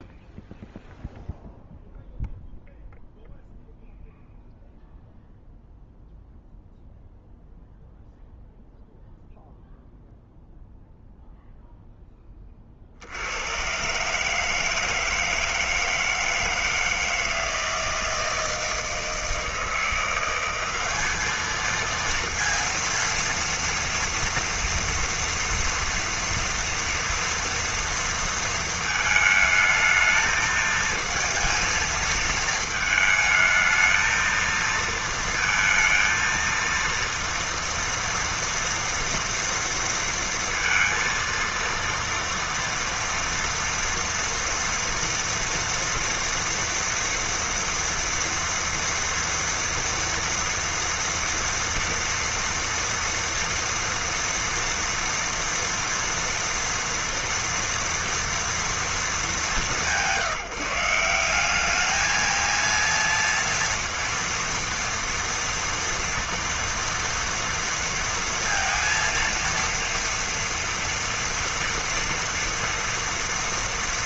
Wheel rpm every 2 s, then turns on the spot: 0, 0, 0, 0, 0, 0, 80, 160, 160, 160, 210, 230, 230, 230, 220, 230, 220, 230, 230, 230, 230, 240, 240, 240, 230, 230, 230, 230, 230, 200, 180, 230, 230, 230, 230, 230, 230.
none